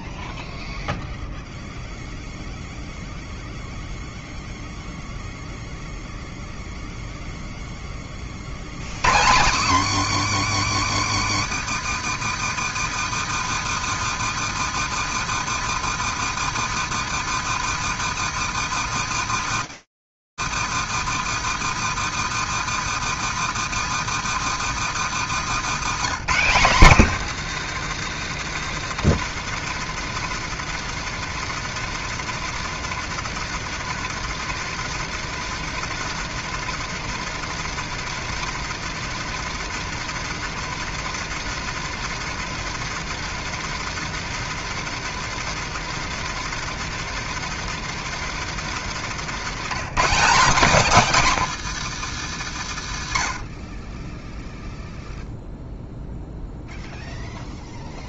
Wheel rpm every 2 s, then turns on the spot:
0, 0, 0, 0, 80, 160, 160, 160, 160, 160, 160, 160, 150, 190, 170, 170, 170, 170, 170, 170, 170, 170, 170, 170, 160, 220, 70, 0, 0.
24-26